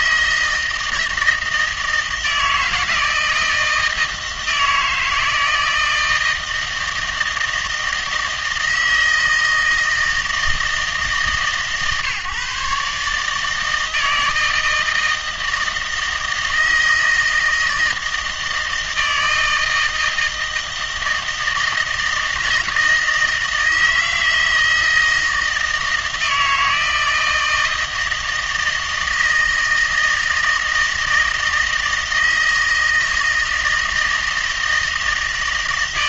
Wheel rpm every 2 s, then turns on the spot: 160, 160, 160, 160, 160, 160, 140, 160, 160, 160, 160, 160, 160, 160, 160, 160, 160, 160.
none